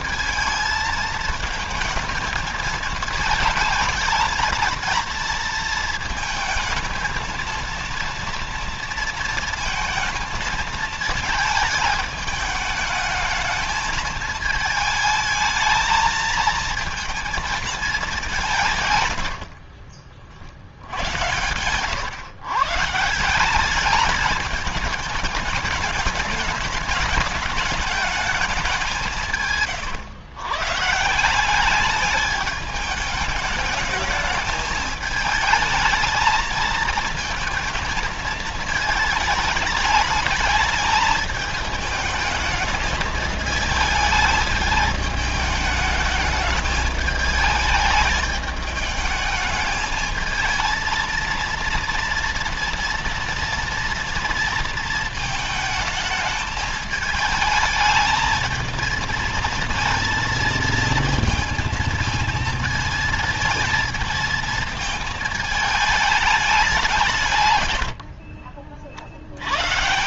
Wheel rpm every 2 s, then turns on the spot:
220, 220, 230, 220, 230, 220, 210, 220, 230, 140, 90, 150, 210, 210, 180, 160, 210, 220, 220, 220, 220, 220, 210, 210, 210, 230, 230, 220, 220, 230, 230, 220, 220, 160, 60.
18-22